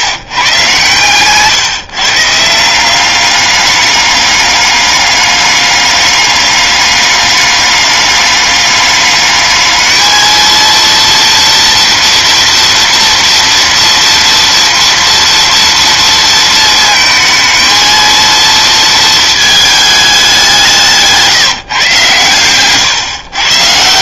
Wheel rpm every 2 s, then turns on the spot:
130, 170, 200, 200, 200, 230, 230, 230, 230, 230, 180, 120.
22-24